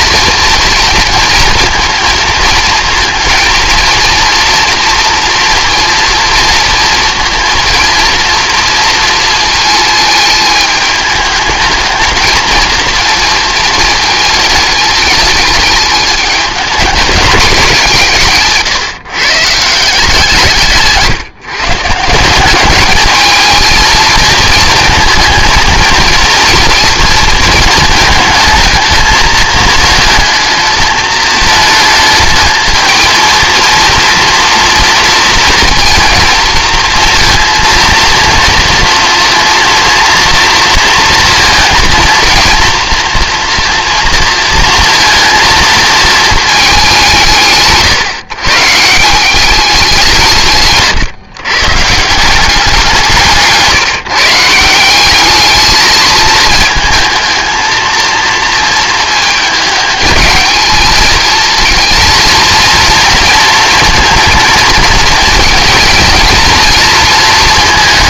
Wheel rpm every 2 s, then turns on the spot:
230, 220, 230, 230, 230, 210, 230, 210, 210, 150, 160, 200, 230, 230, 220, 220, 220, 230, 230, 240, 230, 230, 230, 170, 160, 140, 180, 190, 220, 220, 220, 230, 220, 230.
none